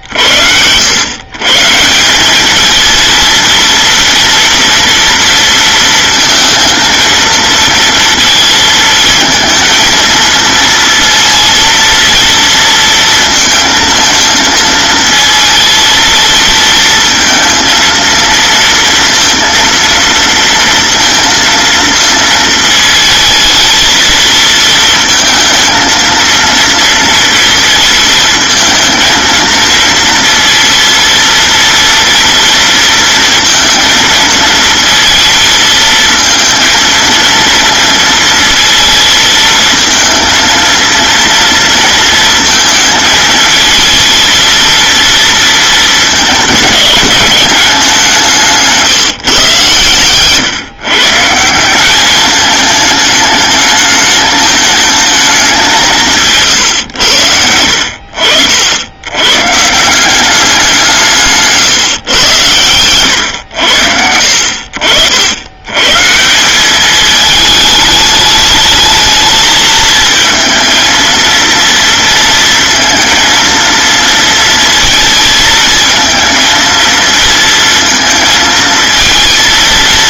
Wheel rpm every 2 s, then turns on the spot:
100, 230, 240, 230, 220, 230, 230, 230, 230, 230, 230, 220, 220, 230, 220, 230, 230, 230, 230, 220, 230, 220, 230, 210, 160, 130, 220, 220, 110, 90, 180, 110, 70, 200, 210, 230, 230, 230, 230, 220.
none